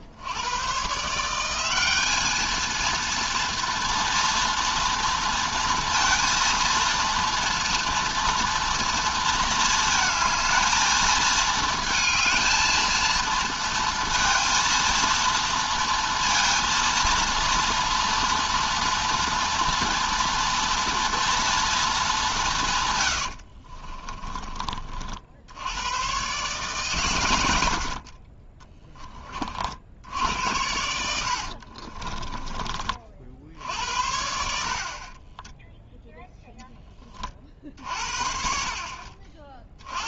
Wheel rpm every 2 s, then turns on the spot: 120, 230, 230, 230, 230, 230, 230, 230, 230, 230, 230, 130, 40, 130, 20, 90, 30, 50, 20, 50.
none